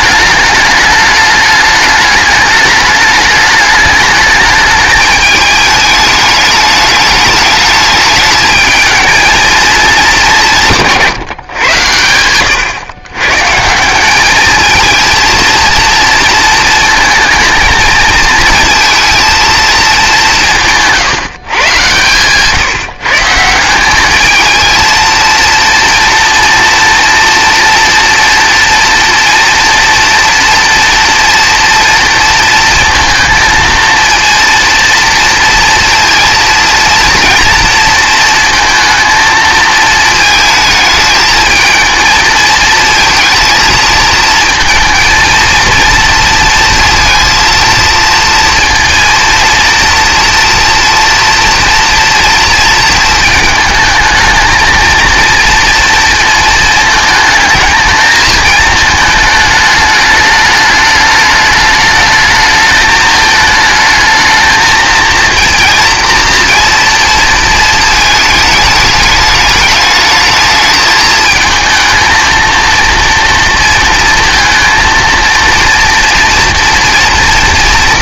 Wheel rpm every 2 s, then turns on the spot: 210, 210, 210, 210, 220, 180, 110, 220, 230, 230, 170, 140, 220, 230, 240, 240, 230, 230, 230, 230, 220, 220, 230, 230, 230, 230, 230, 220, 220, 220, 210, 220, 220, 230, 210, 220, 230, 230, 230.
12-14